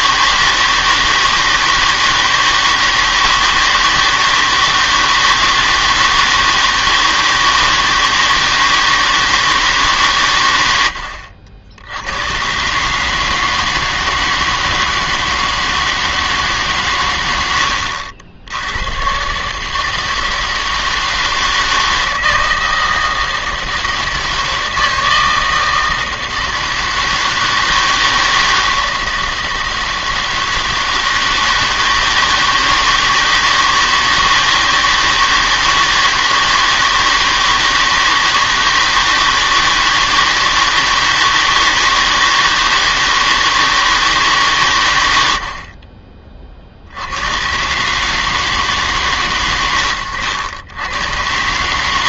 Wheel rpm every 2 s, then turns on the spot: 160, 160, 160, 160, 160, 90, 140, 160, 140, 90, 160, 160, 160, 160, 160, 160, 160, 160, 160, 160, 160, 160, 120, 50, 150, 90.
none